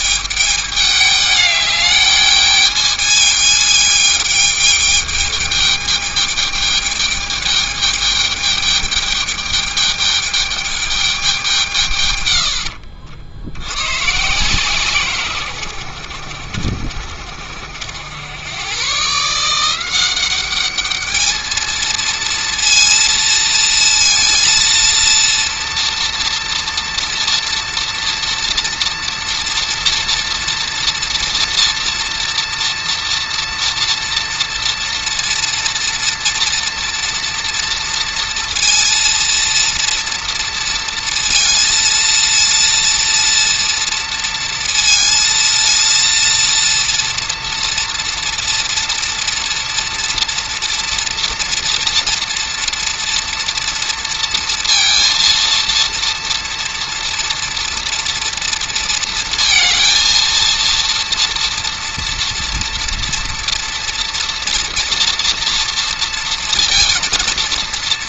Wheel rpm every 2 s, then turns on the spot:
210, 210, 210, 210, 210, 210, 70, 140, 60, 130, 210, 230, 230, 230, 230, 240, 230, 240, 240, 230, 230, 230, 230, 230, 230, 230, 240, 230, 240, 230, 230, 230, 230, 230.
12-14